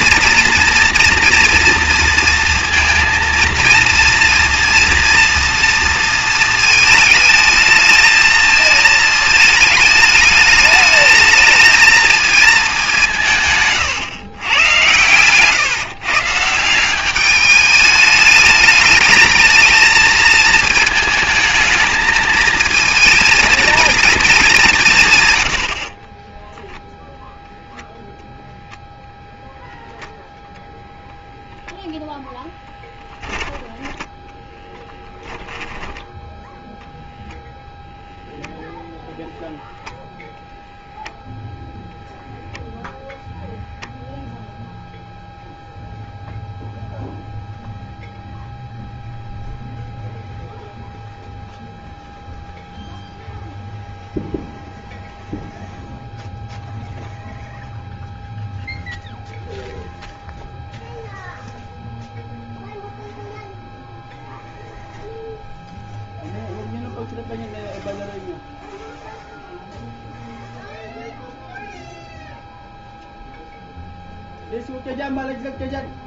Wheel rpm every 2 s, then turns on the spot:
230, 230, 230, 220, 220, 220, 210, 120, 180, 220, 220, 230, 180, 0, 0, 0, 10, 10, 0, 0, 0, 0, 0, 0, 0, 0, 0, 0, 0, 0, 0, 0, 0, 0, 0, 0, 0, 0.
none